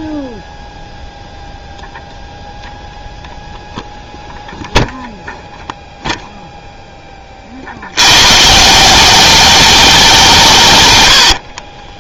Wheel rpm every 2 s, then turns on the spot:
0, 0, 0, 10, 180, 120.
none